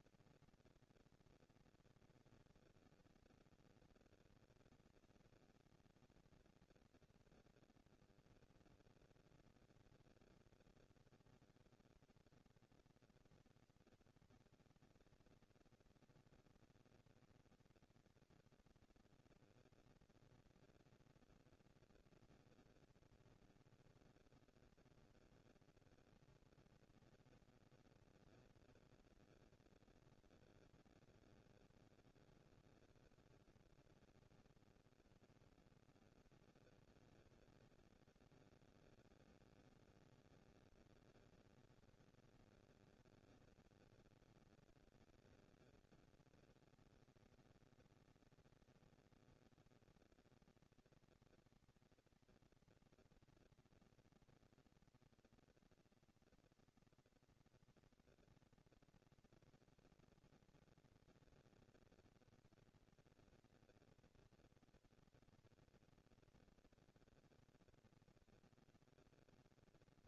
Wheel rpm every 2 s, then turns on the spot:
230, 230, 230, 230, 230, 230, 230, 220, 230, 230, 230, 230, 230, 240, 230, 230, 200, 130, 170, 230, 230, 230, 230, 230, 230, 230, 230, 240, 230, 230, 230, 220, 230, 230, 230.
none